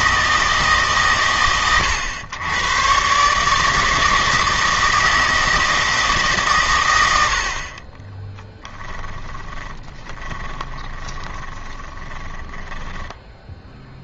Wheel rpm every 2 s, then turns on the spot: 150, 120, 160, 110, 10, 20, 10.
8-14